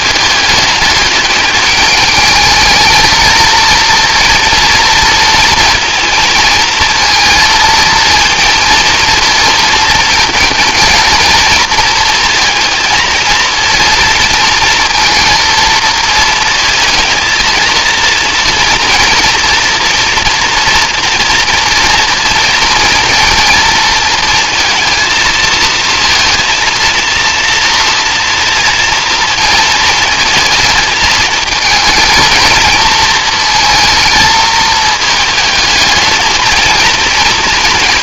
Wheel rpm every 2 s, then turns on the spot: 210, 230, 230, 220, 230, 220, 230, 230, 220, 230, 230, 230, 230, 230, 230, 220, 230, 220, 230.
none